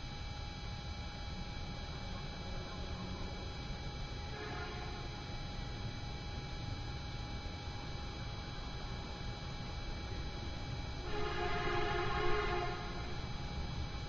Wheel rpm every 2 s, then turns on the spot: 0, 0, 0, 0, 0, 0, 0.
none